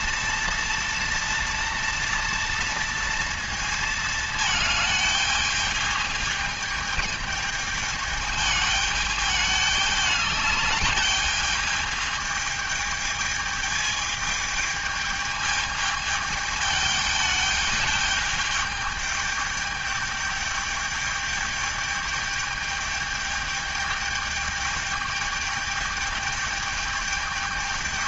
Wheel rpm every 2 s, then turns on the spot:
230, 230, 220, 210, 210, 210, 220, 210, 210, 210, 210, 210, 210, 210.
none